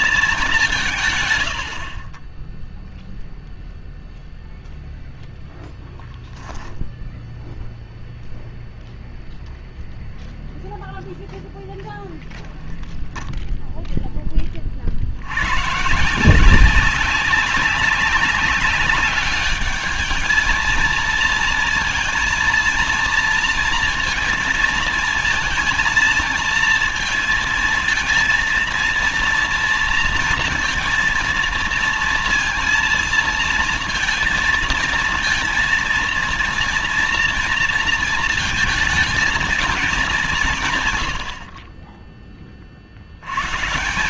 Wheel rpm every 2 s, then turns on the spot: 200, 10, 0, 0, 0, 0, 0, 20, 170, 190, 220, 230, 230, 230, 230, 230, 230, 230, 230, 230, 180, 20.
none